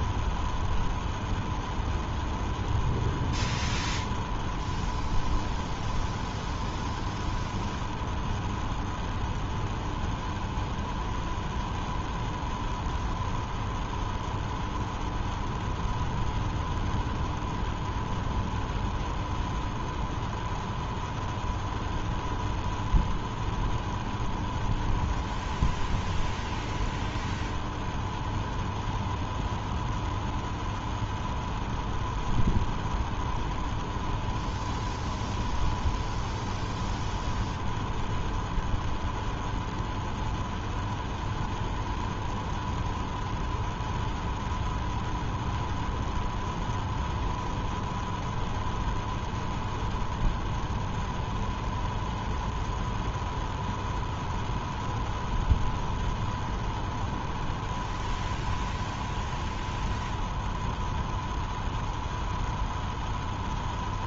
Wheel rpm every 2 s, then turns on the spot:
0, 0, 0, 0, 0, 0, 0, 0, 0, 0, 0, 0, 0, 0, 0, 0, 0, 0, 0, 0, 0, 0, 0, 0, 0, 0, 0, 0, 0, 0, 0, 0.
none